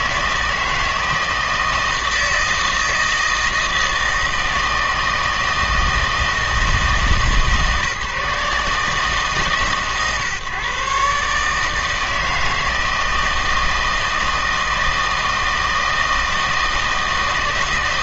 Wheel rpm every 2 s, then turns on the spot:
160, 160, 160, 160, 150, 140, 160, 160, 160.
none